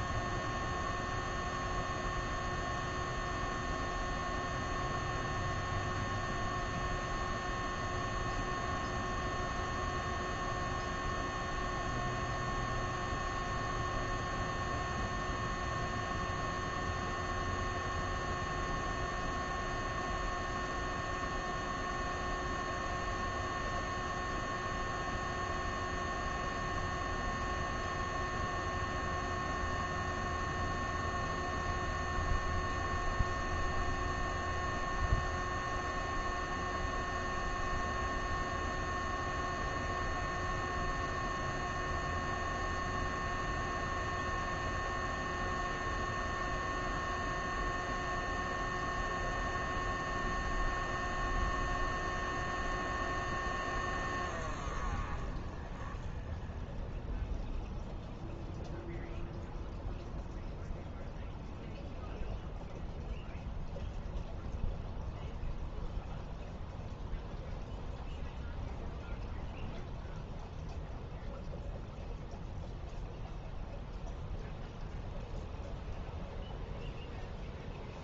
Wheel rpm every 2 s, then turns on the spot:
0, 0, 0, 0, 0, 0, 0, 0, 0, 0, 0, 0, 0, 0, 0, 0, 0, 0, 0, 0, 0, 0, 0, 0, 0, 0, 0, 0, 0, 0, 0, 0, 0, 0, 0, 0, 0, 0, 0.
none